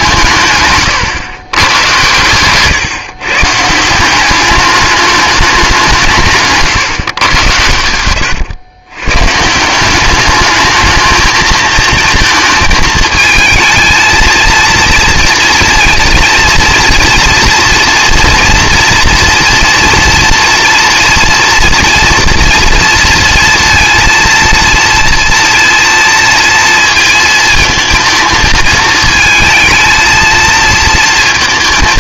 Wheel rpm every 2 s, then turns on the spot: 150, 120, 210, 150, 120, 210, 220, 230, 230, 230, 230, 230, 230, 230, 220, 230.
none